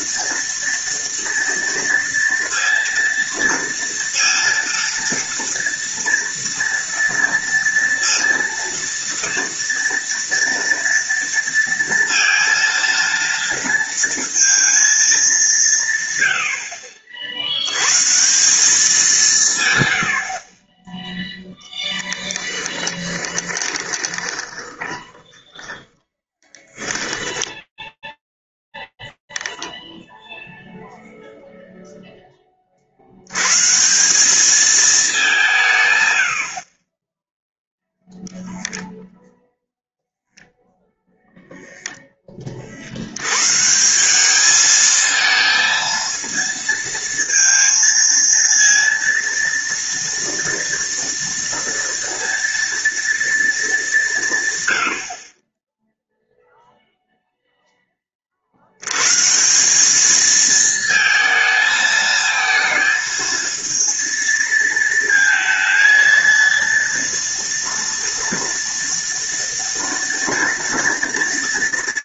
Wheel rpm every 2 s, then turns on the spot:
230, 230, 230, 240, 230, 230, 230, 220, 60, 180, 10, 20, 20, 10, 0, 10, 200, 80, 0, 0, 10, 190, 230, 230, 230, 230, 180, 0, 10, 190, 220, 230, 230, 230, 230, 230.
22-26